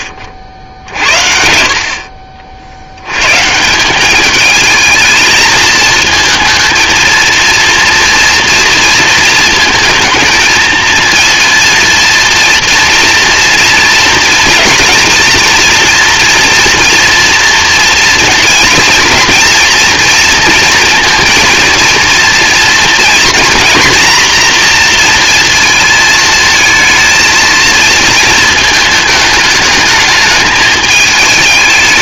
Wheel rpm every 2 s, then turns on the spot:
60, 70, 220, 230, 230, 230, 230, 230, 240, 230, 230, 240, 240, 230, 220, 210.
none